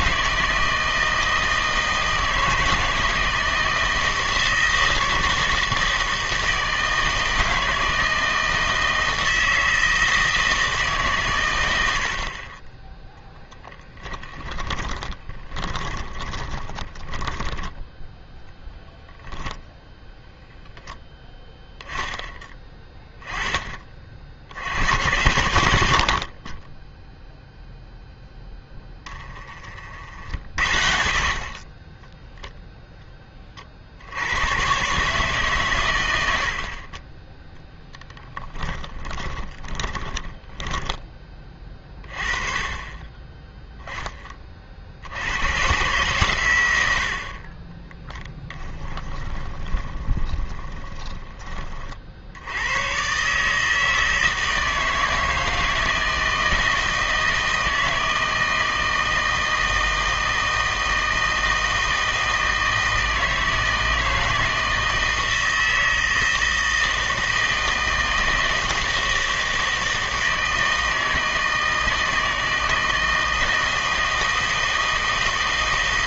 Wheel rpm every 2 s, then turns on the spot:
160, 160, 160, 160, 160, 160, 20, 30, 20, 0, 0, 10, 80, 20, 10, 60, 0, 120, 60, 10, 10, 30, 50, 100, 10, 20, 100, 160, 160, 160, 160, 160, 160, 160, 160, 160, 160, 160.
14-18 38-42 48-52